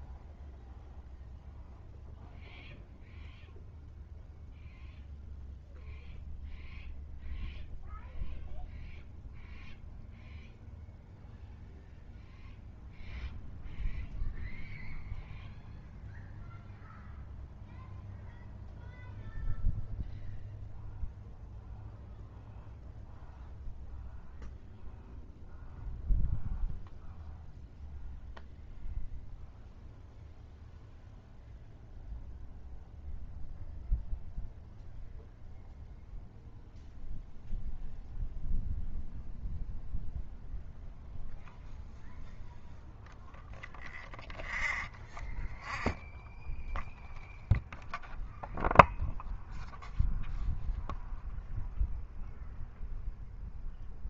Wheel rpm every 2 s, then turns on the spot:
0, 0, 0, 0, 0, 0, 0, 0, 0, 0, 0, 0, 0, 0, 0, 0, 0, 0, 0, 0, 0, 0, 0, 0, 0, 0, 0.
none